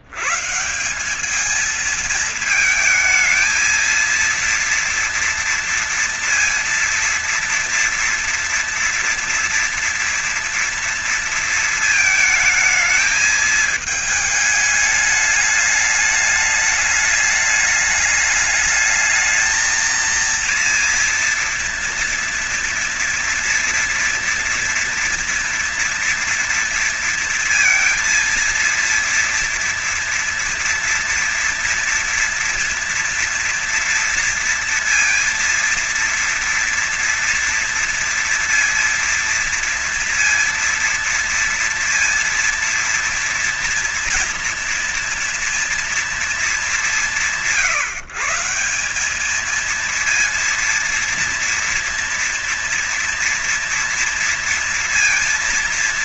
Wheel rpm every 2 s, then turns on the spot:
170, 220, 230, 230, 230, 230, 220, 210, 210, 210, 230, 230, 230, 230, 230, 240, 240, 230, 230, 230, 230, 230, 230, 180, 180, 230, 230, 230.
none